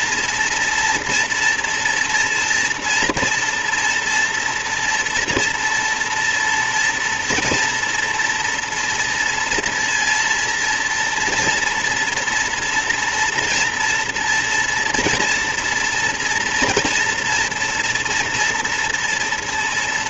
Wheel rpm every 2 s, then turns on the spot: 240, 230, 230, 230, 230, 230, 240, 230, 230, 230.
none